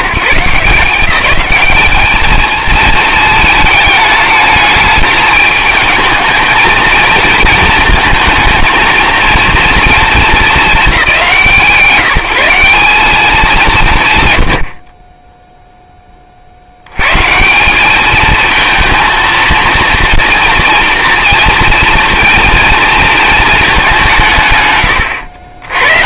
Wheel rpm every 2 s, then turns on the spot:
160, 220, 220, 220, 230, 210, 170, 110, 70, 230, 230, 230, 120.
none